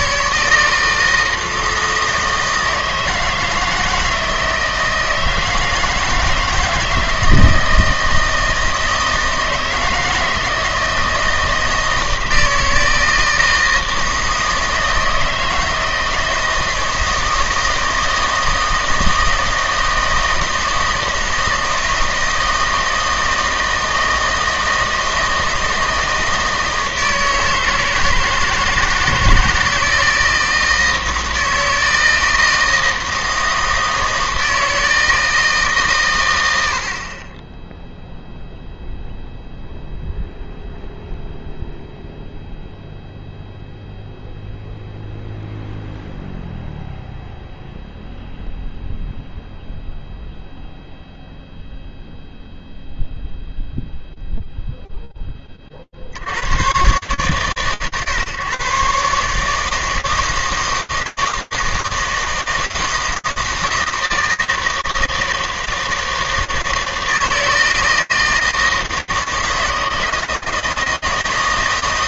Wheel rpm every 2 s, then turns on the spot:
160, 160, 160, 160, 160, 160, 160, 160, 160, 160, 160, 160, 160, 160, 160, 160, 160, 160, 70, 0, 0, 0, 0, 0, 0, 0, 0, 0, 120, 140, 160, 160, 160, 160, 160, 160.
none